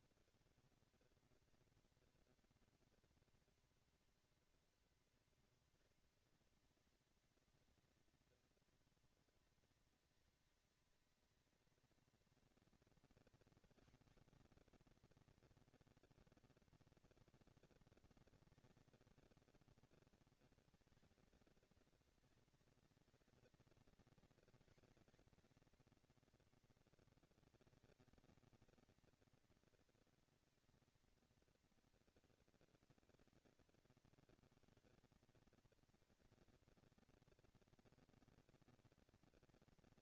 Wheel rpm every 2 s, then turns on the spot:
230, 230, 230, 210, 220, 210, 220, 230, 220, 230, 230, 230, 240, 230, 220, 230, 210, 170, 230, 230.
none